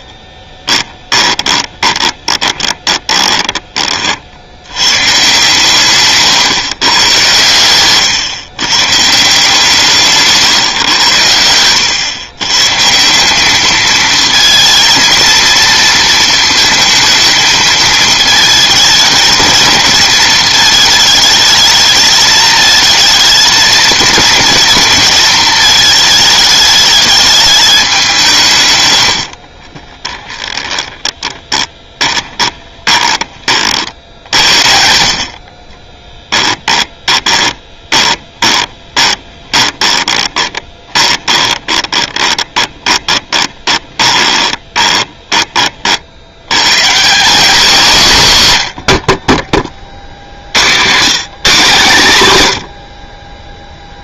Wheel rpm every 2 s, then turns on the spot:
20, 20, 100, 130, 130, 140, 140, 230, 220, 220, 220, 220, 220, 210, 120, 20, 20, 70, 10, 20, 20, 20, 20, 130, 90, 100, 100.
0-4 30-34 36-46